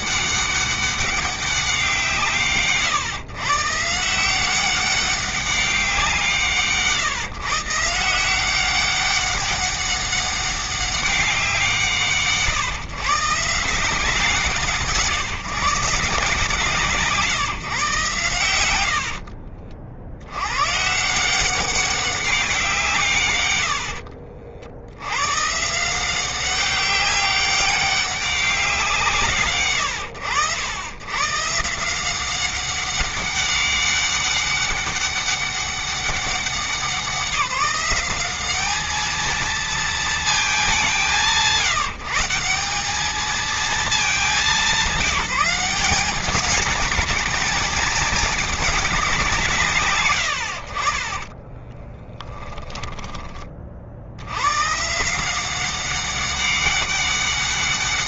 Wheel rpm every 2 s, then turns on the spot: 200, 130, 200, 160, 190, 190, 150, 160, 160, 70, 160, 150, 110, 200, 160, 130, 190, 200, 190, 220, 190, 210, 190, 220, 180, 30, 20, 160, 200.
18-20 50-52